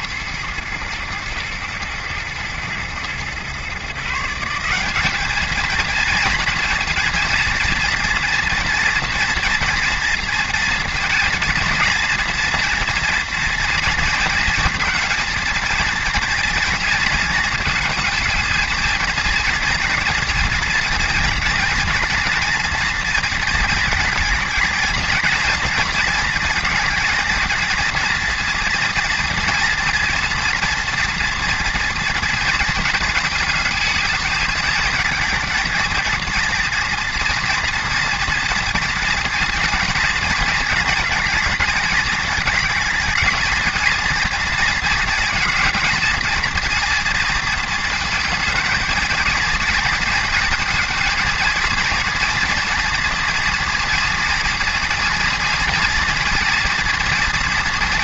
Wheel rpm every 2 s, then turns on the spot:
110, 120, 200, 230, 230, 230, 230, 230, 230, 230, 230, 230, 220, 230, 230, 230, 230, 220, 230, 230, 220, 220, 230, 230, 230, 230, 230, 230, 240.
none